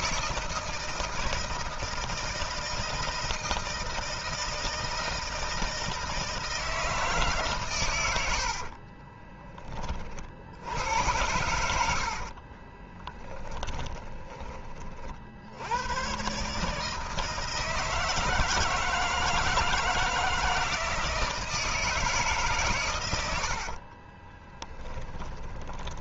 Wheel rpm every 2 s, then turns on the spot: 160, 160, 160, 160, 50, 80, 30, 40, 150, 160, 160, 120, 20.
8-10 12-14 24-26